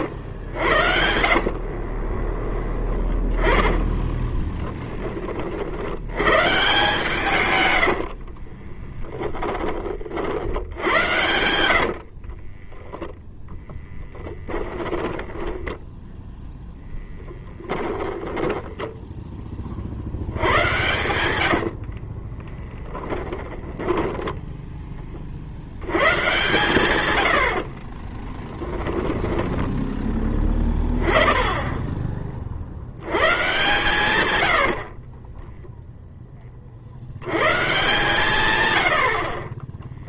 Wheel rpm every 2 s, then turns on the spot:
80, 20, 20, 120, 20, 70, 40, 10, 10, 10, 100, 10, 10, 120, 10, 20, 50, 90, 30, 120.
0-6 8-10 12-16 18-24 28-30